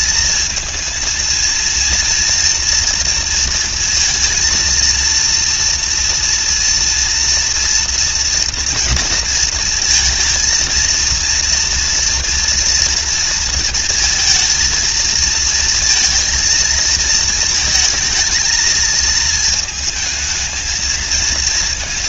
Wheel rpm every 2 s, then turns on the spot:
230, 230, 230, 230, 230, 230, 230, 220, 230, 220, 220.
none